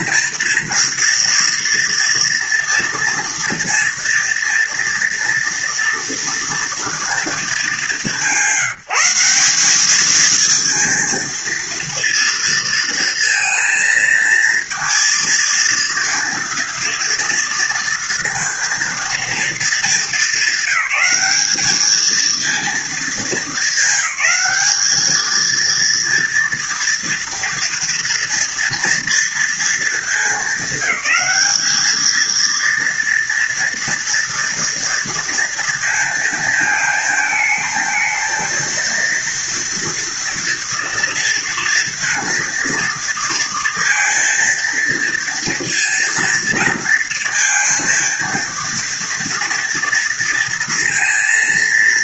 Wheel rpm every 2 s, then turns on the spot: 240, 230, 240, 230, 190, 230, 230, 230, 230, 230, 200, 230, 210, 230, 230, 210, 230, 230, 220, 220, 240, 230, 230, 230, 230, 230.
none